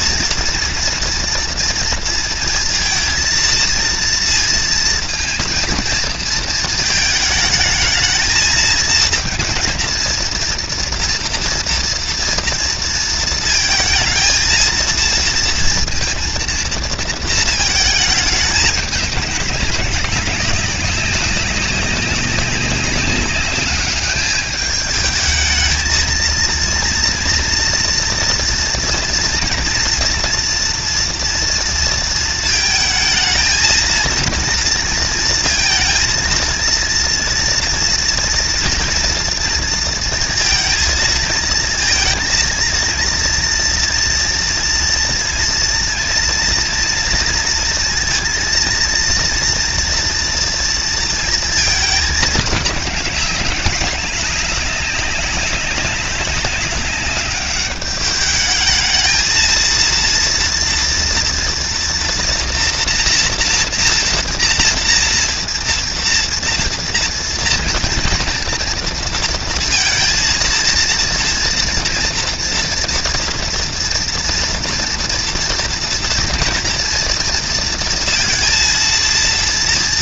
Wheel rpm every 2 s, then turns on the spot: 230, 230, 230, 230, 220, 230, 230, 230, 230, 230, 200, 200, 200, 220, 230, 230, 230, 220, 230, 230, 230, 230, 230, 230, 230, 230, 230, 210, 200, 200, 230, 230, 240, 240, 230, 230, 230, 230, 230, 230.
none